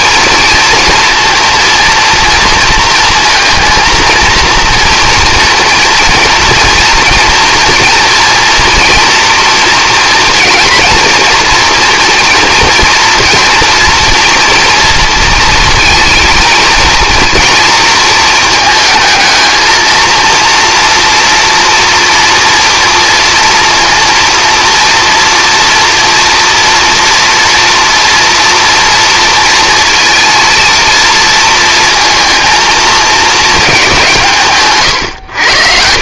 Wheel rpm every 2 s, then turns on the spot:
230, 230, 230, 230, 240, 230, 230, 230, 230, 220, 230, 240, 230, 230, 230, 230, 230, 140.
none